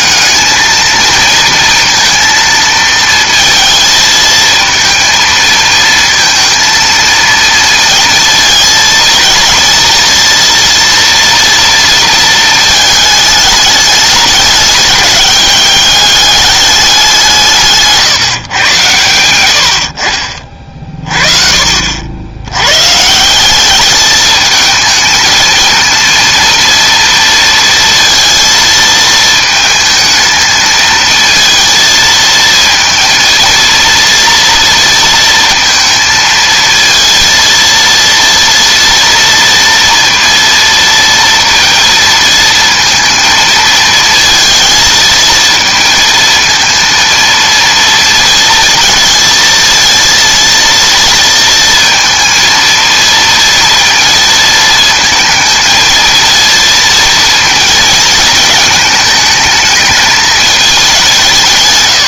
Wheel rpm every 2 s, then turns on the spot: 220, 230, 230, 230, 220, 230, 220, 200, 200, 130, 40, 100, 220, 230, 230, 220, 230, 230, 230, 230, 230, 230, 230, 230, 230, 230, 230, 230, 230, 220, 220.
none